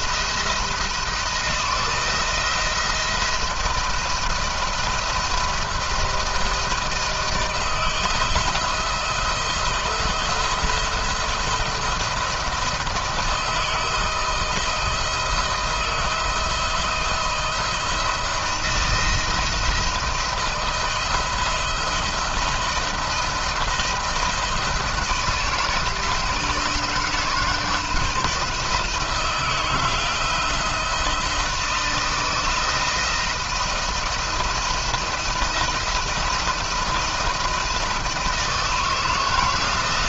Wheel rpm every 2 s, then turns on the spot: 170, 170, 170, 160, 170, 160, 160, 160, 160, 170, 170, 160, 160, 160, 160, 170, 160, 170, 170, 160.
none